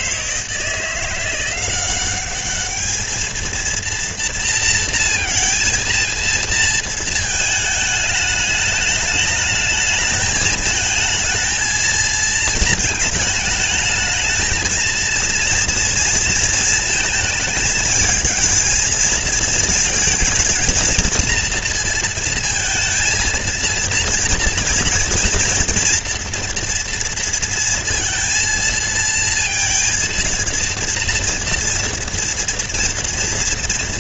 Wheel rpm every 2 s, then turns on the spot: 160, 200, 230, 230, 210, 220, 230, 220, 230, 220, 220, 230, 230, 240, 230, 230, 230.
none